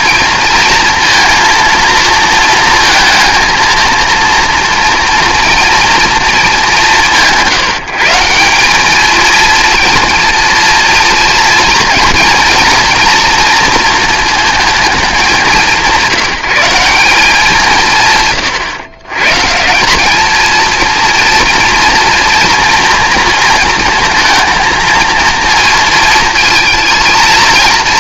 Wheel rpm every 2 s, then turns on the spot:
230, 230, 240, 190, 210, 230, 230, 220, 190, 120, 230, 230, 220, 220.
none